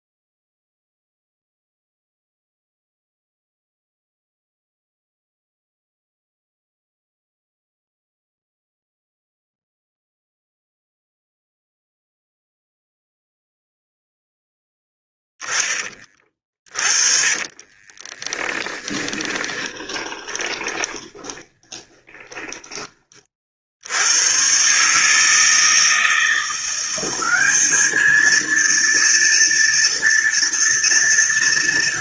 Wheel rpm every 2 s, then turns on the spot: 0, 0, 0, 0, 0, 0, 0, 0, 30, 10, 20, 20, 140, 180, 230, 230.
16-22